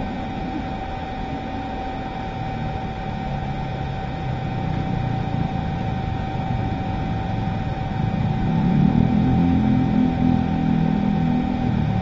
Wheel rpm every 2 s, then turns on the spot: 0, 0, 0, 0, 0, 0.
none